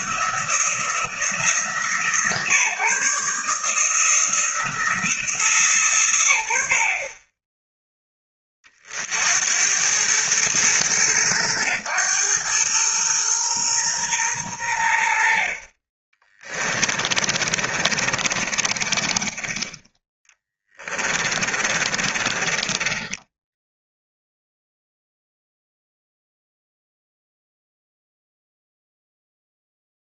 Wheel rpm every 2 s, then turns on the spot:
170, 140, 170, 60, 40, 110, 110, 90, 30, 30, 20, 30, 0, 0, 0.
16-22